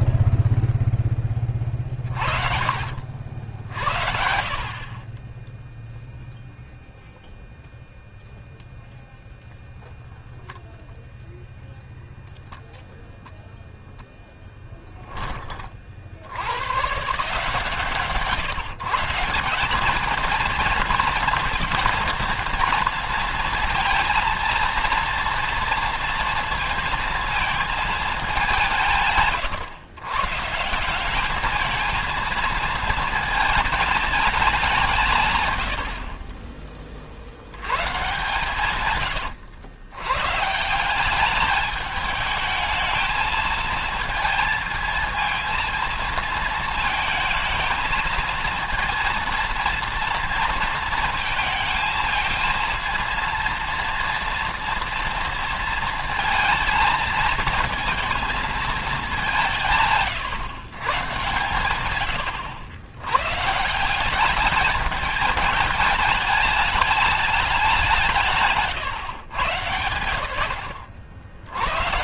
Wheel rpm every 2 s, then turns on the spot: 10, 50, 30, 0, 0, 0, 0, 10, 130, 160, 230, 230, 230, 230, 170, 180, 220, 160, 40, 120, 170, 220, 230, 230, 230, 220, 230, 230, 230, 200, 120, 110, 210, 210, 140, 70.
2-6